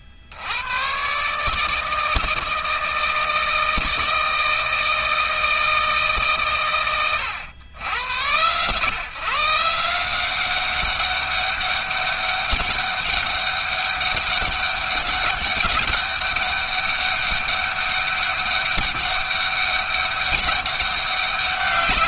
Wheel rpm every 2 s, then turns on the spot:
130, 160, 160, 120, 120, 200, 200, 200, 200, 200, 200.
none